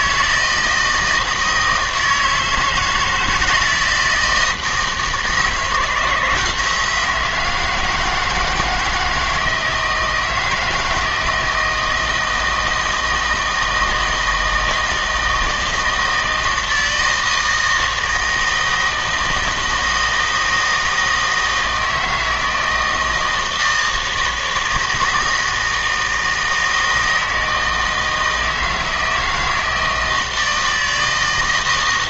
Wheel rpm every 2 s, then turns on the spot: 160, 160, 160, 160, 170, 160, 160, 160, 160, 160, 160, 160, 160, 160, 160, 160.
none